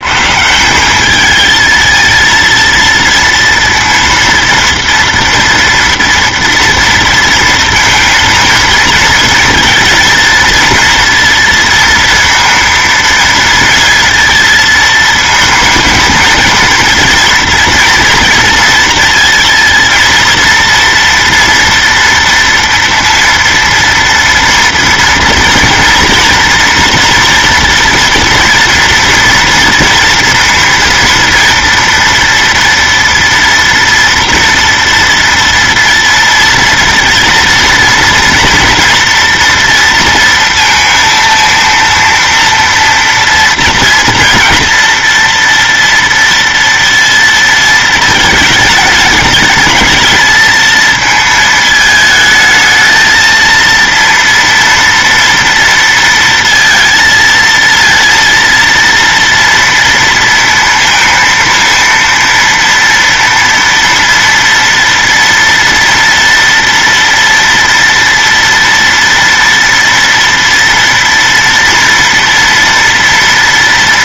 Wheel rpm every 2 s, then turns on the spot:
170, 230, 230, 230, 220, 230, 230, 230, 230, 230, 230, 230, 230, 240, 230, 230, 230, 230, 230, 240, 230, 230, 230, 230, 210, 220, 220, 230, 230, 230, 230, 230, 230, 230, 230, 230, 230.
none